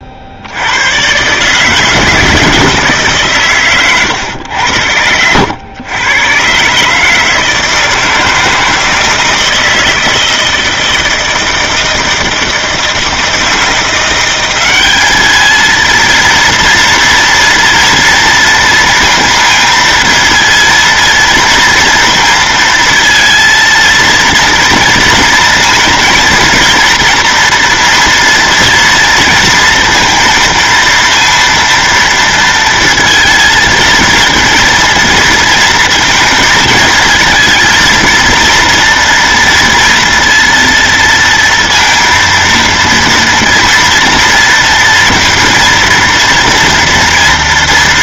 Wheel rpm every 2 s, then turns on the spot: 80, 160, 90, 130, 160, 160, 160, 190, 230, 230, 230, 230, 230, 230, 230, 230, 230, 230, 230, 230, 230, 230, 230, 230.
none